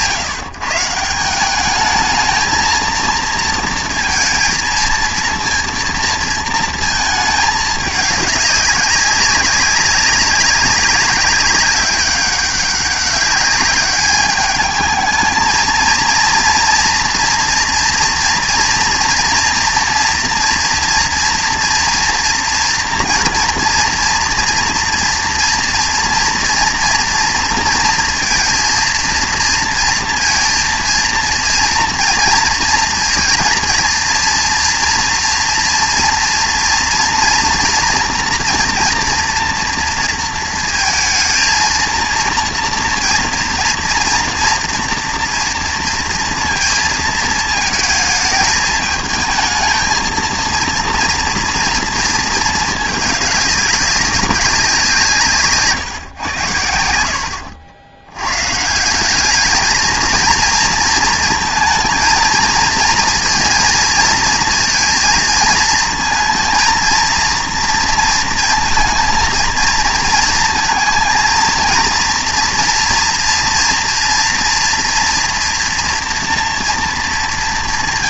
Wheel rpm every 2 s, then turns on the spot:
150, 230, 230, 220, 200, 200, 200, 210, 240, 230, 230, 230, 240, 230, 230, 230, 230, 230, 230, 230, 230, 230, 230, 230, 220, 230, 220, 190, 80, 170, 230, 230, 220, 230, 230, 230, 230, 230, 230.
none